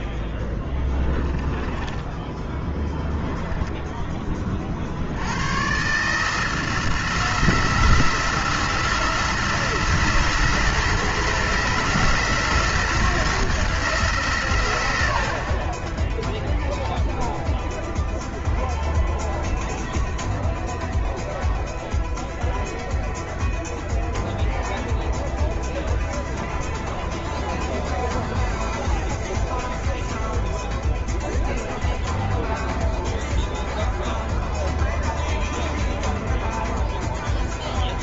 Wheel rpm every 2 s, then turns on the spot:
10, 10, 50, 160, 160, 160, 160, 100, 0, 0, 0, 0, 0, 0, 0, 0, 0, 0, 0.
0-4